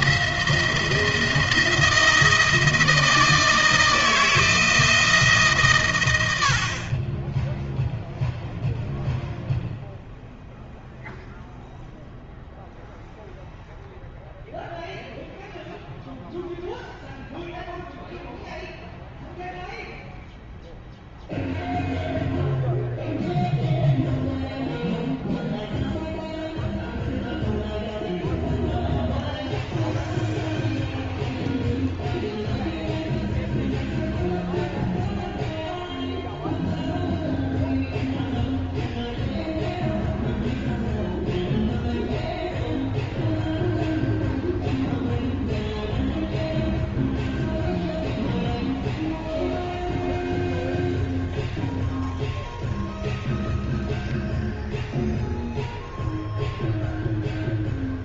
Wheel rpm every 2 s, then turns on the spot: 170, 160, 160, 40, 0, 0, 0, 0, 0, 0, 0, 0, 0, 0, 0, 0, 0, 0, 0, 0, 0, 0, 0, 0, 0, 0, 0, 0, 0.
none